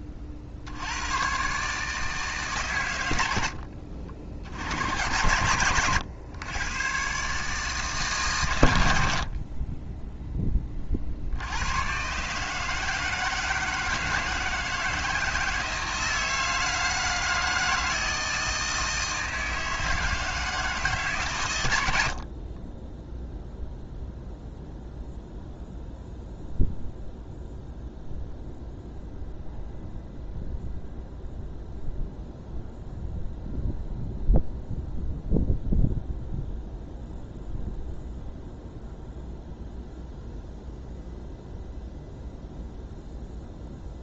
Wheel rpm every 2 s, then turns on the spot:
70, 140, 80, 110, 110, 20, 150, 160, 160, 160, 160, 30, 0, 0, 0, 0, 0, 0, 0, 0, 0, 0.
22-24